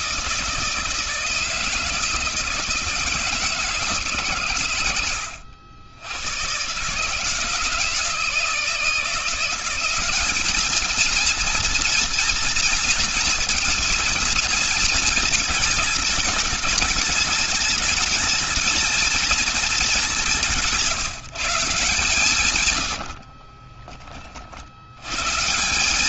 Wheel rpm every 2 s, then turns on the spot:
160, 160, 100, 150, 180, 220, 230, 220, 210, 220, 170, 60, 120.
22-24